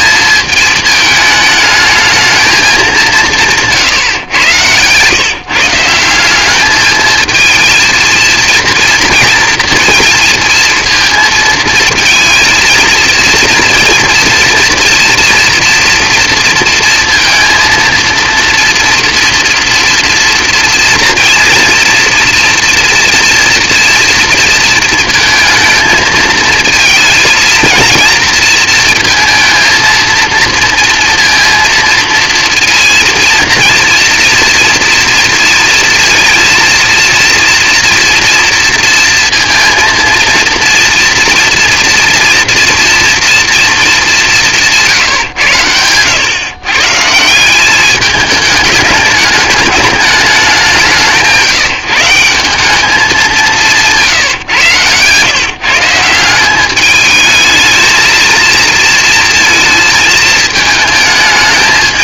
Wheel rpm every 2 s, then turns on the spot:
220, 160, 150, 220, 230, 230, 230, 240, 230, 230, 240, 230, 230, 230, 230, 230, 230, 230, 230, 230, 230, 230, 110, 180, 210, 170, 180, 140, 220, 230, 220.
none